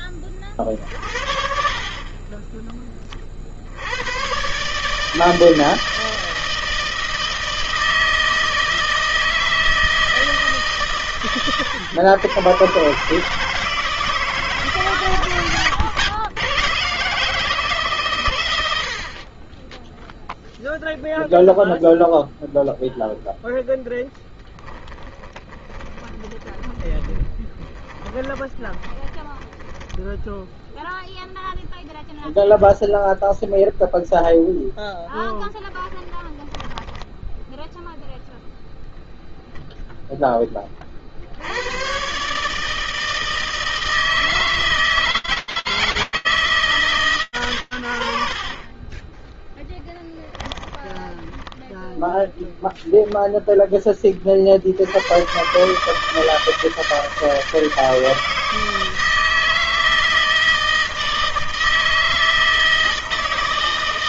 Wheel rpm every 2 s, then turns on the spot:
30, 30, 150, 160, 160, 130, 140, 140, 140, 60, 0, 0, 10, 20, 10, 0, 0, 0, 10, 0, 30, 150, 160, 160, 50, 10, 0, 90, 160, 160, 160, 160.
24-30 36-38